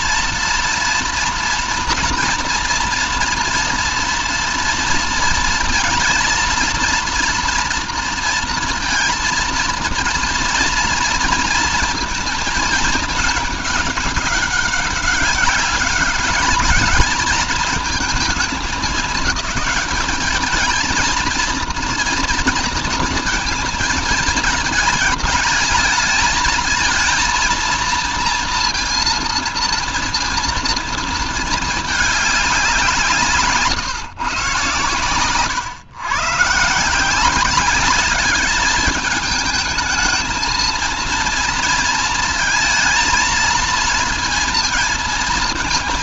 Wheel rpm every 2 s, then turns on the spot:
240, 240, 230, 230, 230, 230, 220, 200, 210, 210, 220, 230, 220, 230, 230, 230, 180, 120, 160, 210, 230, 230, 230.
none